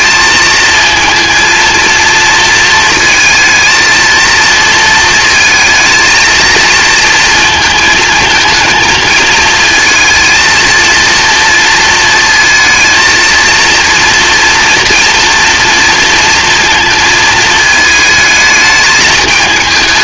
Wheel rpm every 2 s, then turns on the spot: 230, 220, 220, 230, 220, 230, 230, 230, 220, 220.
none